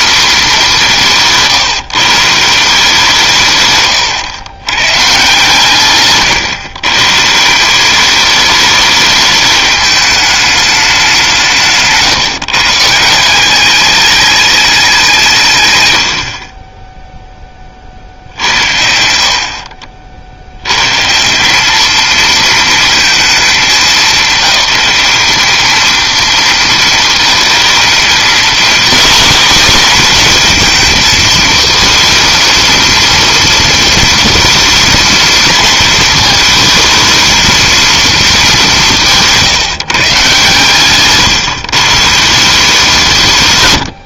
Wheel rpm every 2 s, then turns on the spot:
210, 170, 120, 120, 210, 210, 150, 200, 20, 70, 110, 230, 200, 230, 250, 230, 230, 230, 230, 200, 130, 180.
none